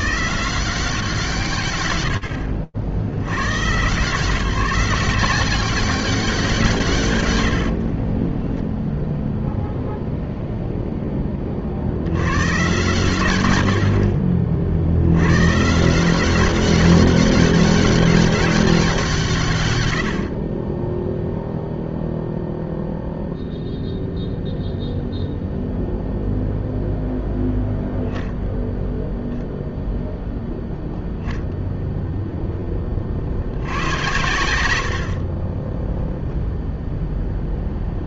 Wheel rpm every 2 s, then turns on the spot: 130, 130, 190, 60, 0, 60, 80, 150, 200, 130, 0, 0, 0, 0, 0, 0, 100, 10, 0.
6-8